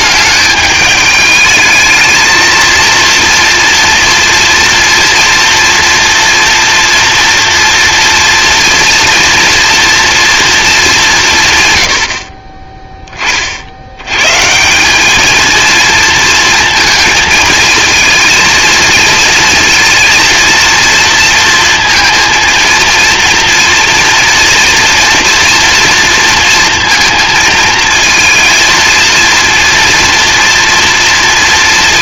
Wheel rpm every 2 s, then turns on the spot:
210, 230, 230, 240, 230, 220, 30, 160, 230, 230, 230, 230, 230, 230, 230, 230.
none